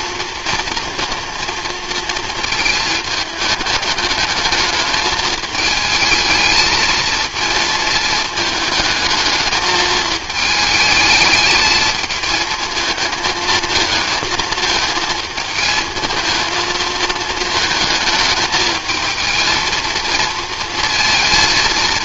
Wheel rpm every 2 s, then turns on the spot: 230, 220, 210, 220, 220, 220, 220, 220, 220, 220, 230.
none